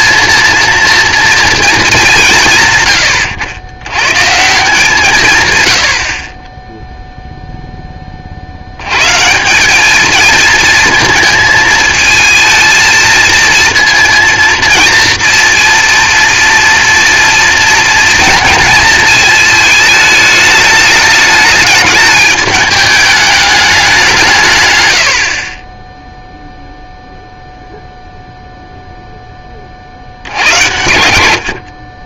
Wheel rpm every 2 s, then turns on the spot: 230, 130, 160, 20, 90, 220, 230, 230, 230, 230, 210, 210, 130, 0, 0, 90.
none